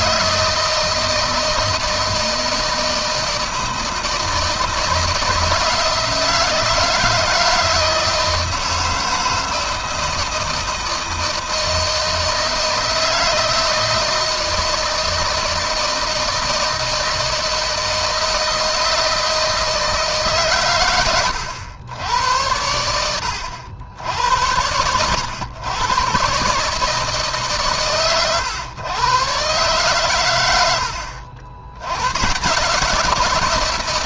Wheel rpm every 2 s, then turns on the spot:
160, 160, 160, 160, 160, 160, 160, 160, 160, 160, 120, 80, 110, 150, 120, 80, 160.
none